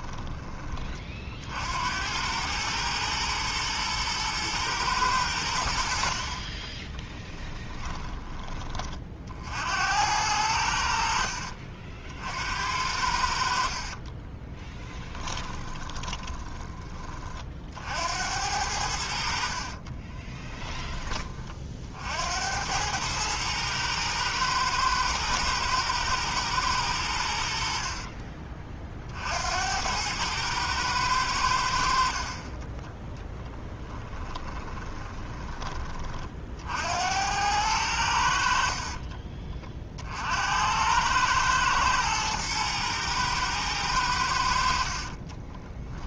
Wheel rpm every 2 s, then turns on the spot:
30, 110, 110, 20, 30, 80, 70, 20, 20, 70, 20, 90, 110, 100, 40, 100, 10, 20, 70, 40, 90, 110, 50.
6-8 14-16 32-36 38-40 44-46